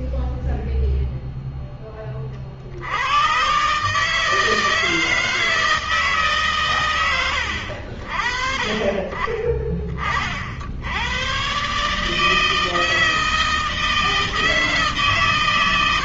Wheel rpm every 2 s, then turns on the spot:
0, 80, 160, 130, 30, 80, 160, 150.
none